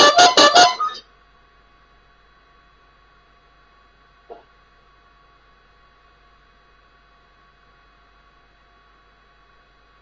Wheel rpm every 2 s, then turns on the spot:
0, 0, 0, 0, 0.
none